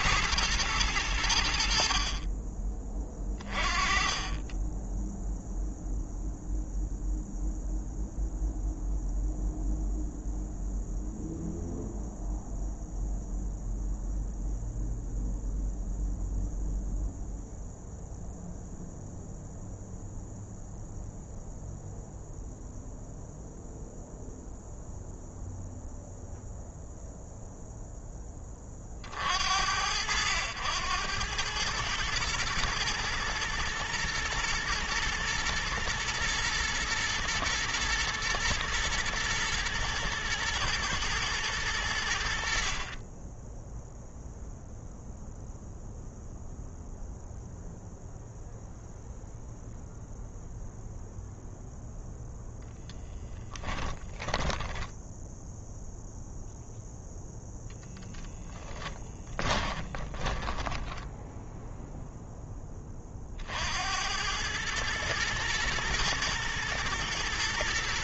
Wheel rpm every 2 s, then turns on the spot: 100, 30, 10, 0, 0, 0, 0, 0, 0, 0, 0, 0, 0, 0, 50, 100, 110, 110, 120, 120, 110, 40, 0, 0, 0, 0, 0, 10, 0, 20, 10, 20, 110, 120.
54-56 58-62